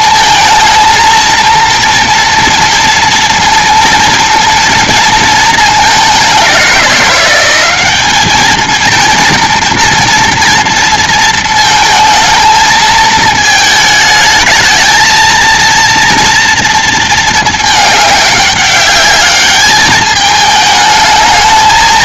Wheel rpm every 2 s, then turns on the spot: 220, 230, 230, 190, 220, 230, 220, 220, 230, 200, 220.
none